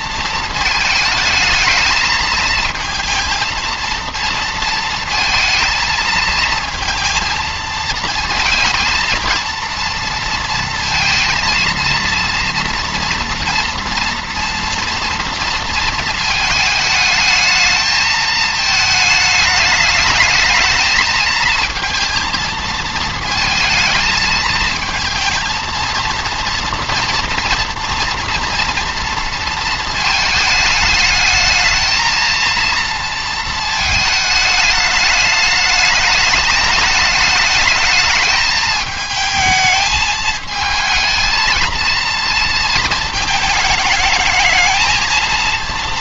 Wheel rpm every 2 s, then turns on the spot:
220, 230, 230, 230, 230, 230, 230, 240, 220, 220, 220, 220, 220, 230, 230, 210, 230, 210, 210, 220, 220, 230, 220.
none